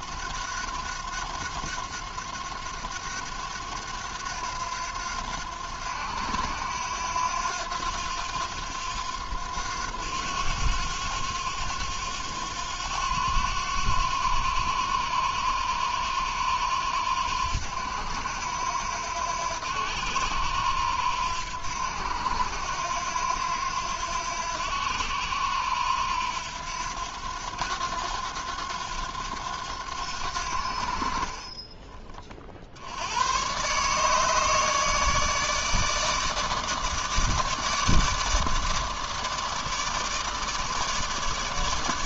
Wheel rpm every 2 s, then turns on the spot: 90, 90, 90, 90, 90, 90, 90, 90, 90, 80, 90, 90, 90, 90, 90, 70, 60, 150, 150, 150, 150.
none